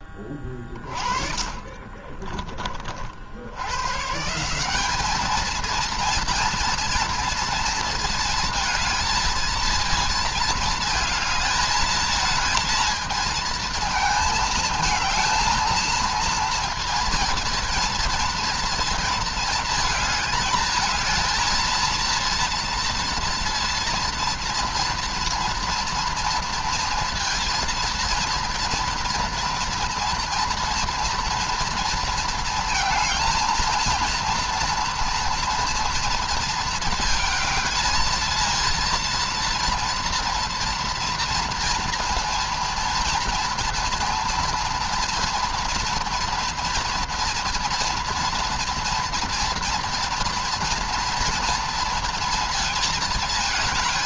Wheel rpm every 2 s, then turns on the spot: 30, 40, 190, 230, 230, 220, 220, 220, 230, 230, 220, 230, 240, 230, 230, 230, 220, 230, 230, 230, 230, 230, 230, 240, 230, 230, 230.
0-2